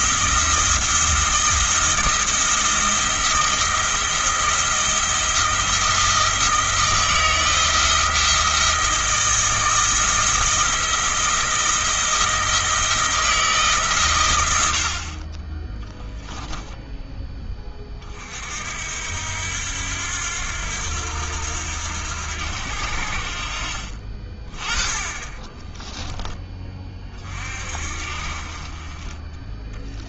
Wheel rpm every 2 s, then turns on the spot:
170, 170, 170, 160, 160, 170, 170, 70, 10, 70, 80, 70, 20, 20, 30.
14-16